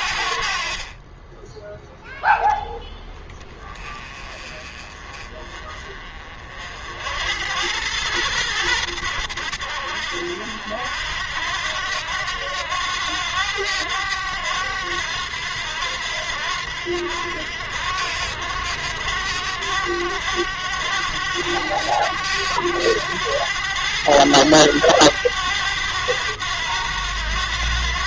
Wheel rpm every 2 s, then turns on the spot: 50, 10, 30, 50, 100, 70, 90, 90, 90, 90, 100, 100, 100, 90.
none